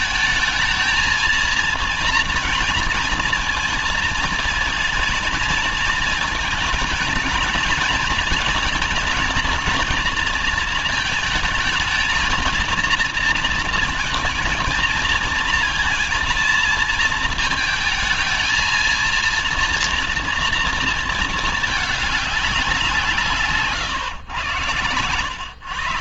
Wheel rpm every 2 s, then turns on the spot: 220, 230, 230, 230, 230, 230, 230, 230, 230, 220, 230, 190, 120.
none